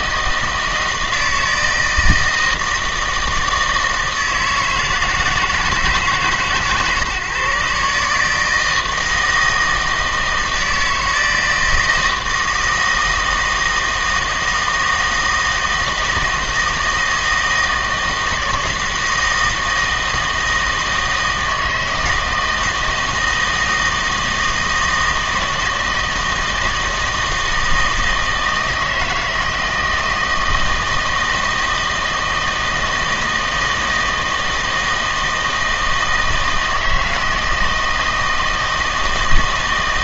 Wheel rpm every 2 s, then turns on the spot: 160, 160, 160, 150, 160, 160, 160, 160, 160, 160, 160, 160, 160, 160, 160, 160, 160, 160, 160, 160.
none